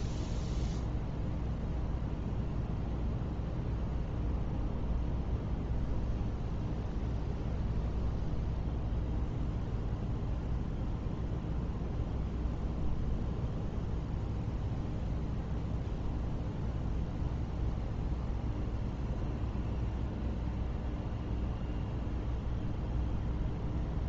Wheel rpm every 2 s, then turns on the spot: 0, 0, 0, 0, 0, 0, 0, 0, 0, 0, 0, 0.
none